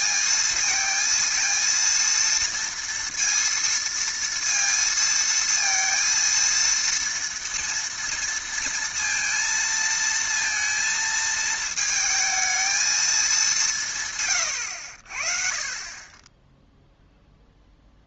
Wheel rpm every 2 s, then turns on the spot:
220, 230, 230, 230, 230, 230, 220, 100, 10.
none